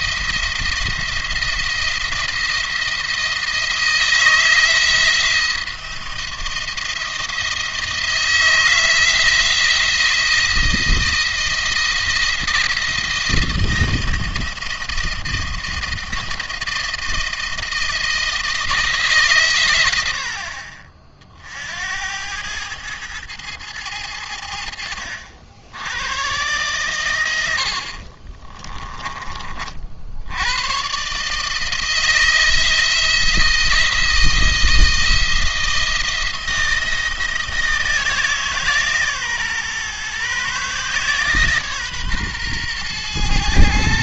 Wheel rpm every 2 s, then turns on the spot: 170, 170, 170, 170, 160, 160, 170, 170, 160, 160, 50, 110, 80, 120, 30, 120, 170, 160, 170, 150, 140, 120.
28-30